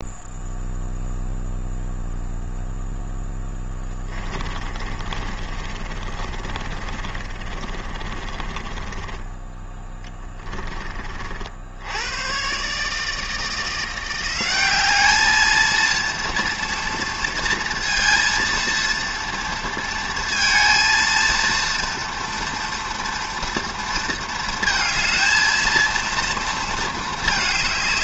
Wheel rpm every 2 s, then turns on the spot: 0, 0, 30, 30, 20, 40, 150, 210, 230, 230, 230, 230, 220, 220.
4-10